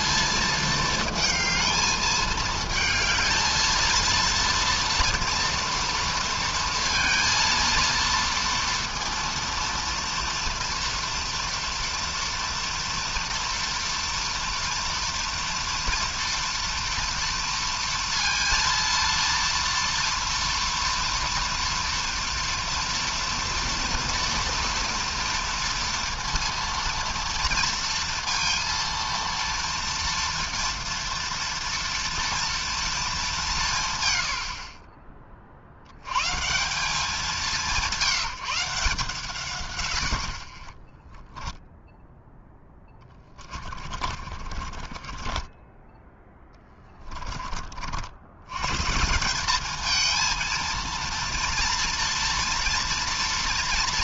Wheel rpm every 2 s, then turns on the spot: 220, 220, 230, 230, 230, 230, 230, 230, 230, 230, 230, 230, 230, 230, 230, 230, 230, 70, 140, 170, 40, 10, 40, 10, 120, 230, 230.
44-46